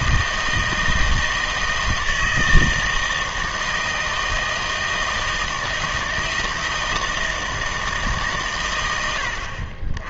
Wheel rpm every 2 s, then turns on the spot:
160, 160, 160, 160, 110.
none